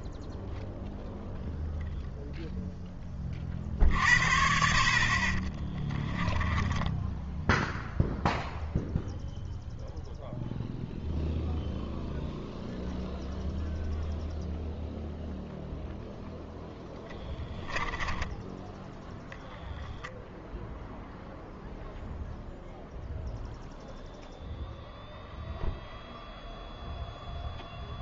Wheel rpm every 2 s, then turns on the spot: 0, 0, 50, 10, 0, 0, 0, 0, 10, 20, 0, 0, 0, 0.
6-8